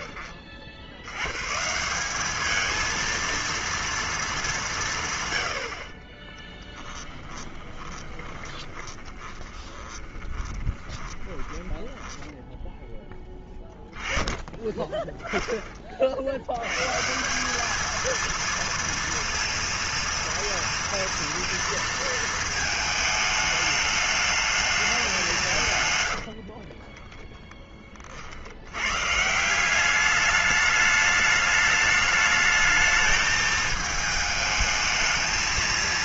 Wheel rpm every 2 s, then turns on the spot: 60, 230, 140, 10, 30, 20, 0, 10, 140, 230, 230, 220, 210, 30, 80, 210, 210, 210.
6-12 26-28